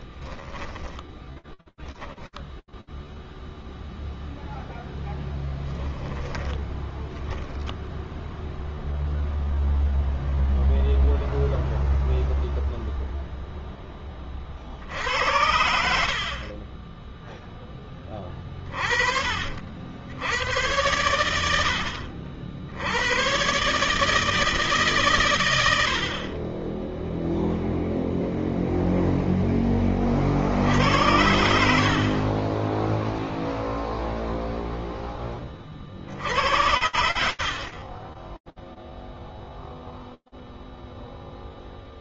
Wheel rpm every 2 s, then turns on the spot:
10, 0, 0, 10, 0, 0, 10, 70, 20, 80, 70, 130, 90, 0, 20, 60, 0, 50, 30, 0, 0.
none